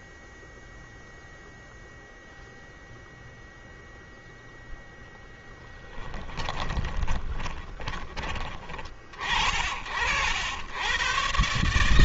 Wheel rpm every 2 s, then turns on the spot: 0, 0, 0, 10, 20, 80.
6-8